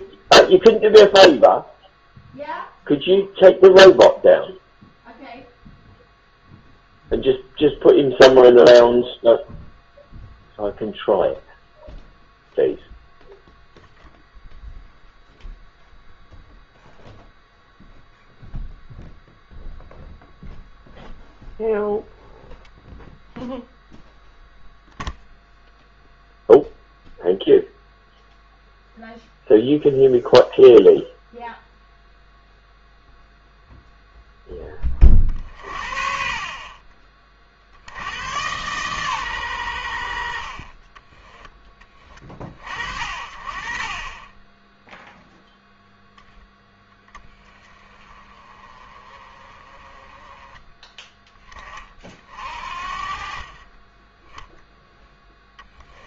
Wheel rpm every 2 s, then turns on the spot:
0, 0, 0, 0, 0, 0, 0, 0, 0, 0, 0, 0, 0, 0, 0, 0, 0, 20, 40, 130, 30, 40, 10, 10, 30, 20, 40, 0.
40-42